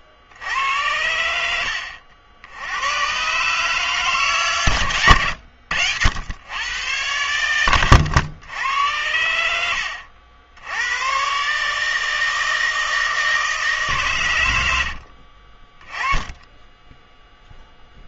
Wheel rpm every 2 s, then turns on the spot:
60, 70, 140, 100, 90, 80, 160, 100, 20.
none